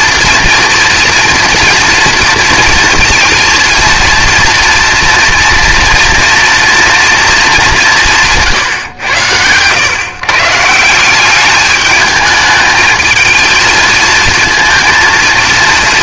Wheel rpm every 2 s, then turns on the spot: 230, 230, 230, 230, 140, 160, 220, 230.
none